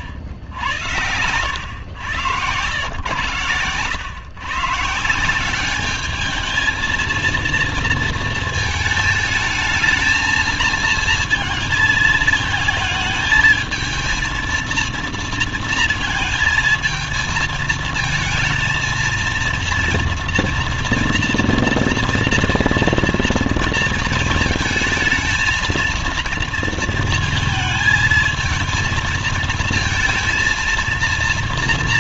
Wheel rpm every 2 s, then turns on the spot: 80, 110, 130, 220, 220, 220, 220, 230, 230, 230, 230, 230, 220, 230, 220, 220.
none